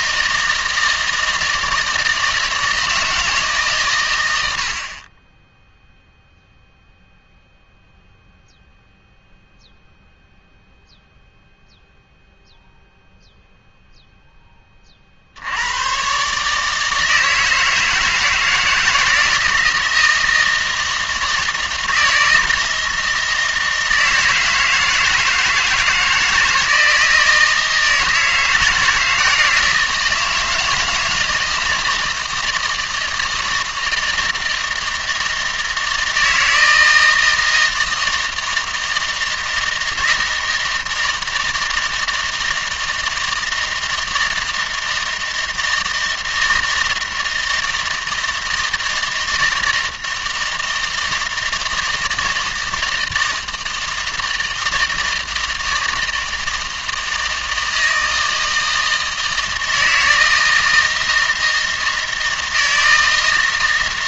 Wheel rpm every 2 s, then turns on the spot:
160, 160, 70, 0, 0, 0, 0, 20, 160, 160, 160, 160, 160, 160, 170, 160, 160, 160, 160, 160, 160, 160, 160, 160, 160, 160, 160, 160, 160, 160, 160, 160.
none